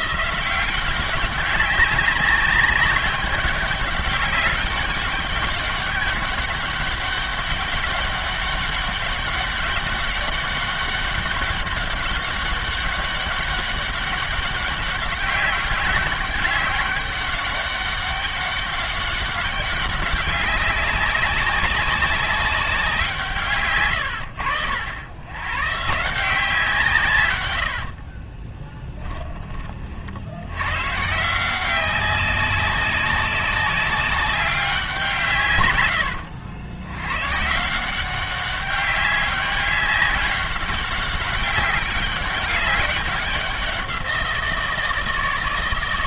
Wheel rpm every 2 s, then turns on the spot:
170, 200, 200, 200, 200, 200, 200, 200, 200, 190, 190, 200, 90, 170, 20, 100, 190, 190, 90, 190, 190, 200, 170.
28-30